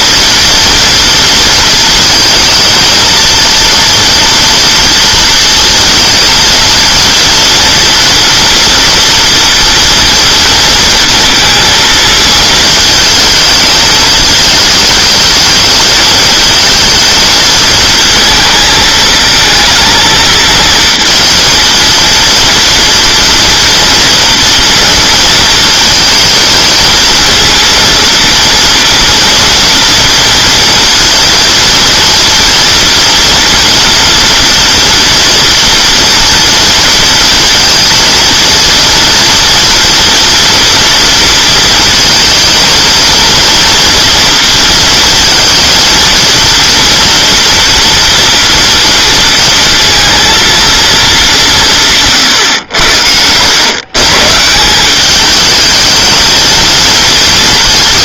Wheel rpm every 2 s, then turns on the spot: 230, 230, 230, 230, 230, 230, 220, 220, 220, 220, 230, 230, 230, 230, 230, 230, 230, 240, 230, 230, 230, 230, 230, 240, 230, 230, 80, 180, 220.
none